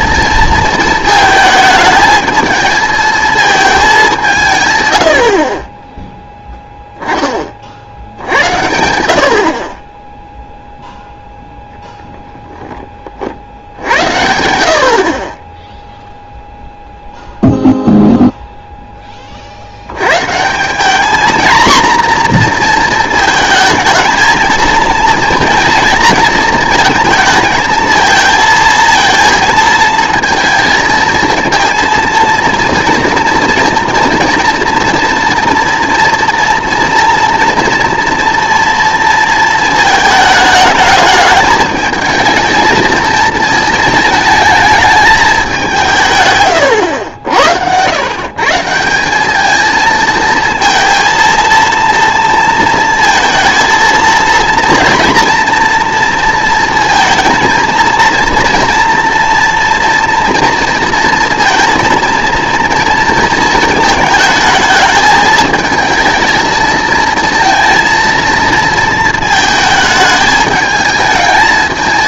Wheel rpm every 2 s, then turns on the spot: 220, 220, 130, 10, 90, 0, 10, 70, 0, 0, 190, 230, 230, 230, 230, 230, 230, 230, 230, 230, 210, 220, 220, 120, 160, 230, 230, 230, 230, 230, 230, 230, 220, 230, 230, 210.
none